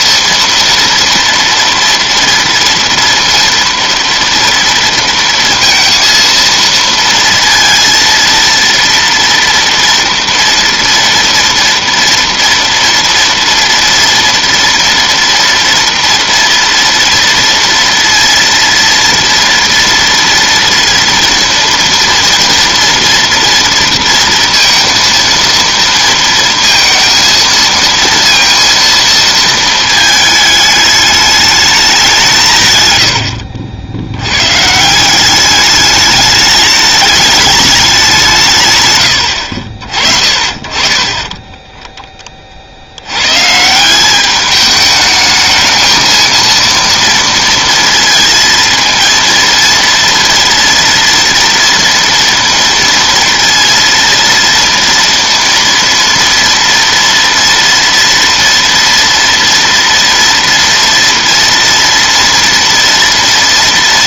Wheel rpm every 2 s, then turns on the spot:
230, 230, 230, 230, 230, 230, 230, 230, 230, 230, 230, 230, 230, 230, 230, 210, 120, 150, 210, 130, 30, 50, 210, 230, 230, 230, 230, 230, 230, 230, 230, 230.
none